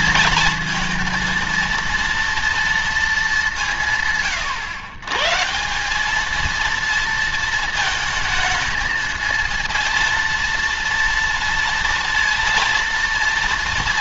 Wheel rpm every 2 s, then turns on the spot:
220, 230, 130, 200, 220, 230, 230.
none